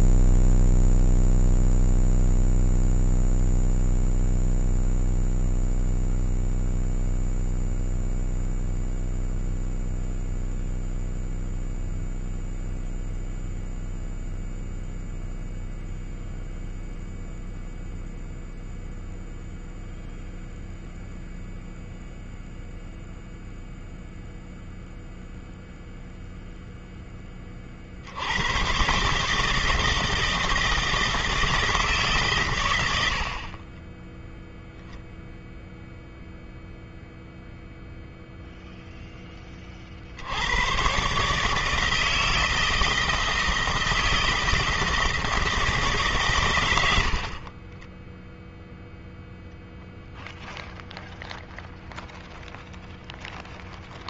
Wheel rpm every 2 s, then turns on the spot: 0, 0, 0, 0, 0, 0, 0, 0, 0, 0, 0, 0, 0, 10, 130, 160, 80, 0, 0, 10, 130, 160, 160, 70, 0, 0, 0.
none